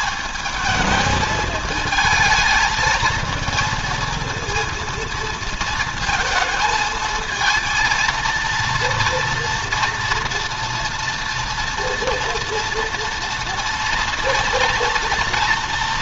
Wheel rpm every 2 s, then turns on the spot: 220, 220, 230, 220, 230, 230, 230, 230.
none